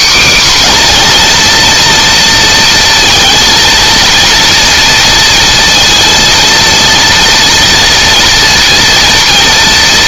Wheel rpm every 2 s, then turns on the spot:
250, 230, 230, 230, 230.
none